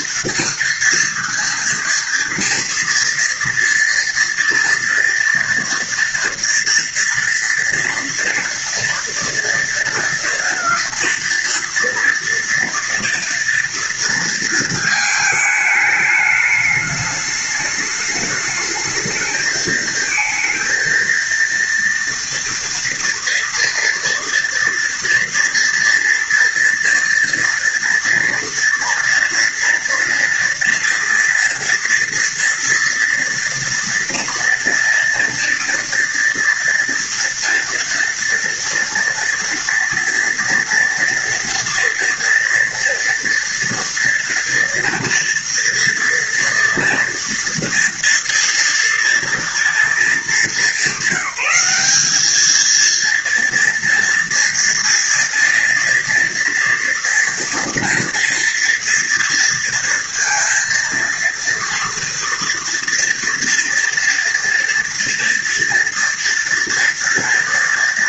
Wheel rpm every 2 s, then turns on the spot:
230, 230, 240, 230, 230, 230, 230, 220, 210, 220, 230, 230, 240, 230, 230, 230, 230, 230, 230, 230, 230, 240, 240, 230, 230, 190, 220, 230, 230, 230, 230, 230, 230, 230.
none